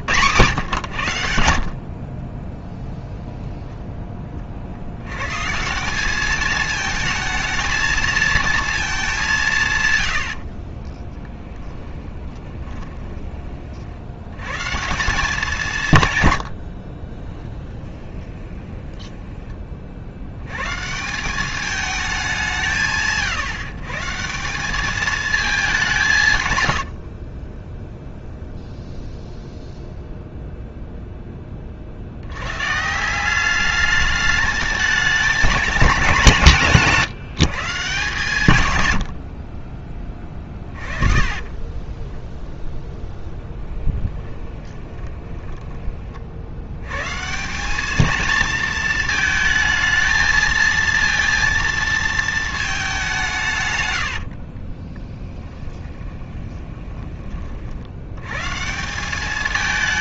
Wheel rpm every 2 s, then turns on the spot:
130, 10, 60, 220, 220, 50, 20, 150, 100, 20, 120, 170, 190, 100, 0, 0, 110, 210, 170, 110, 20, 0, 10, 100, 220, 230, 220, 40, 20, 150.
10-14 16-20 26-28 40-42 44-46 54-58